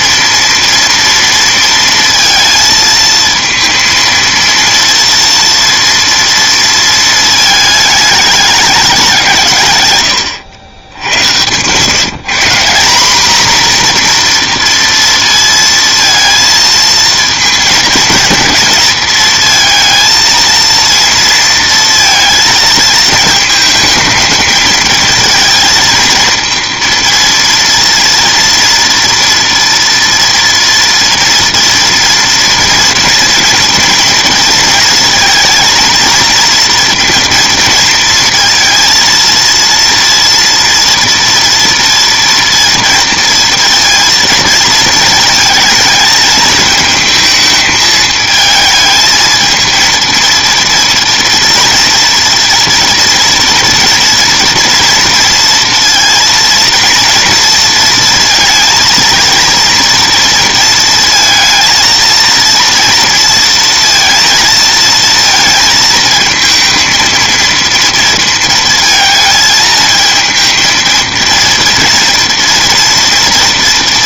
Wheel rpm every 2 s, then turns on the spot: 230, 220, 230, 230, 200, 90, 190, 230, 230, 230, 230, 230, 220, 230, 230, 230, 230, 230, 230, 230, 230, 230, 220, 220, 220, 230, 230, 230, 230, 230, 230, 230, 230, 220, 220, 220, 230.
none